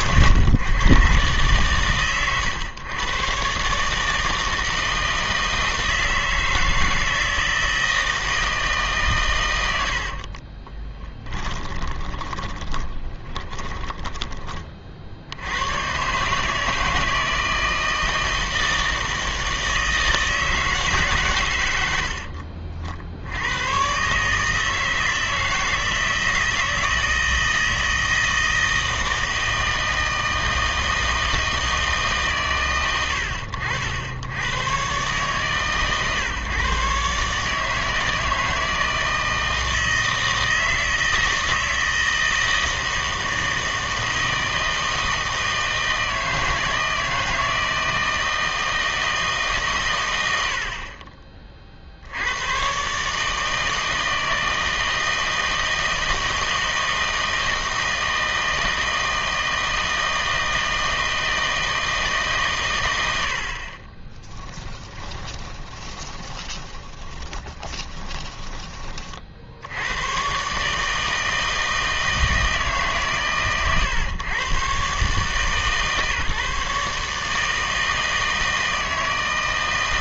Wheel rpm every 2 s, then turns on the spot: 130, 110, 160, 160, 150, 20, 20, 40, 160, 160, 160, 50, 160, 160, 160, 160, 110, 120, 140, 160, 160, 160, 160, 160, 160, 60, 130, 160, 160, 160, 160, 110, 10, 20, 20, 150, 150, 130, 150, 160.
10-14 64-68